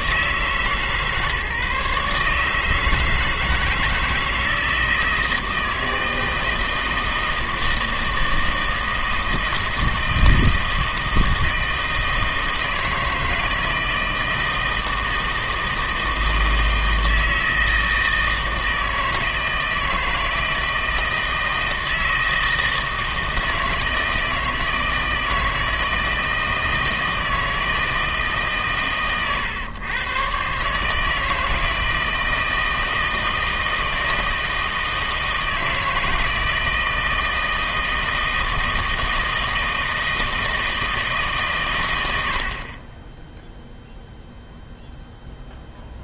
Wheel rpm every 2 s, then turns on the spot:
150, 160, 160, 160, 160, 160, 160, 160, 160, 160, 160, 160, 160, 160, 140, 140, 160, 160, 160, 160, 160, 30, 0.
none